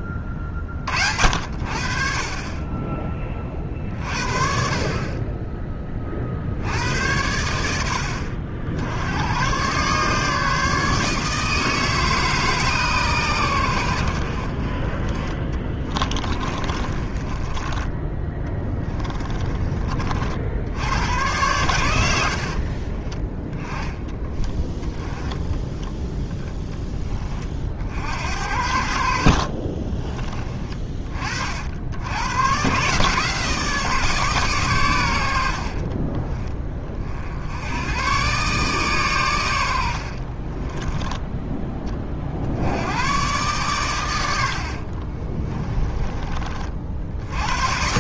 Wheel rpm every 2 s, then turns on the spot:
50, 20, 40, 90, 80, 150, 130, 20, 30, 20, 90, 20, 20, 20, 70, 30, 140, 90, 30, 120, 10, 110, 50, 80.
16-20 22-24 44-46